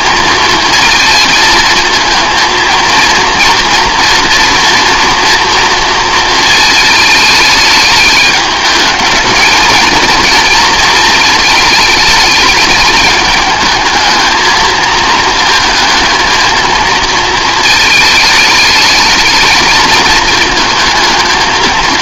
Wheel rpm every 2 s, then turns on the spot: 220, 230, 240, 220, 210, 230, 210, 230, 230, 220, 220.
none